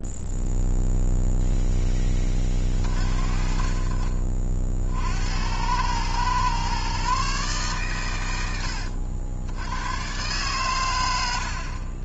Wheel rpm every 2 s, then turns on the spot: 0, 40, 60, 130, 80, 110.
none